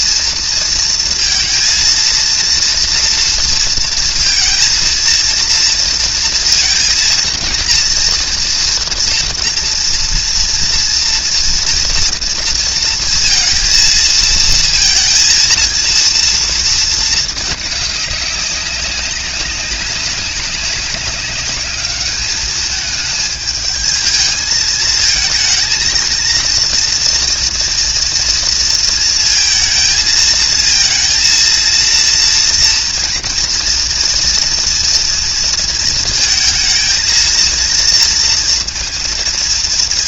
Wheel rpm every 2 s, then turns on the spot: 230, 230, 230, 230, 240, 230, 230, 220, 230, 190, 190, 210, 220, 230, 230, 230, 230, 230, 220, 230.
none